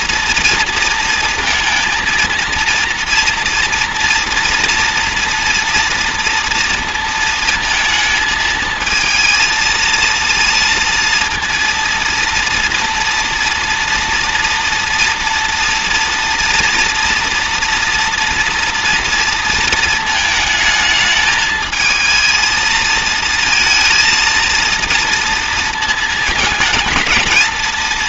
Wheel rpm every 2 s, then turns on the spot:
230, 230, 240, 230, 220, 230, 230, 230, 230, 230, 220, 230, 230, 220.
none